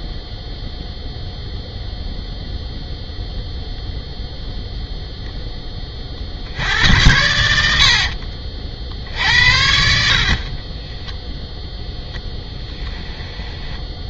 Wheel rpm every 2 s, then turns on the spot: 0, 0, 0, 80, 50, 20, 10.
10-14